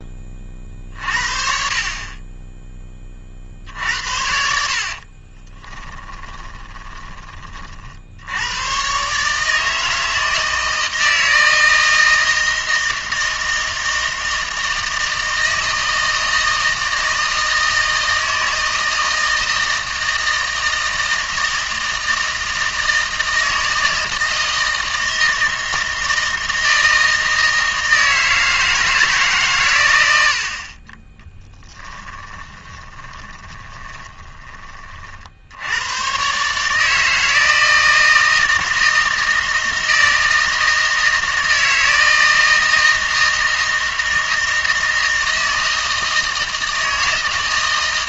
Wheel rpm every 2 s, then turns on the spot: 40, 10, 60, 20, 110, 160, 160, 160, 160, 160, 160, 160, 160, 160, 160, 40, 10, 30, 150, 160, 160, 160, 160, 160.
4-8 32-34